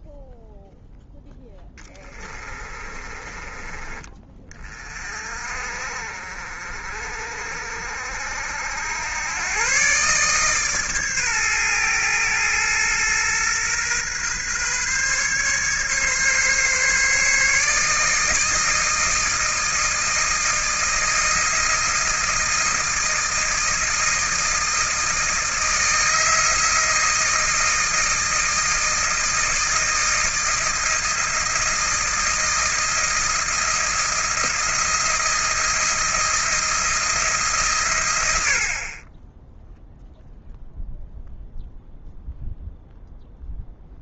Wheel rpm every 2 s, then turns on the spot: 0, 20, 30, 40, 80, 140, 110, 140, 140, 160, 160, 160, 160, 160, 160, 170, 170, 170, 170, 50, 0, 0.
2-4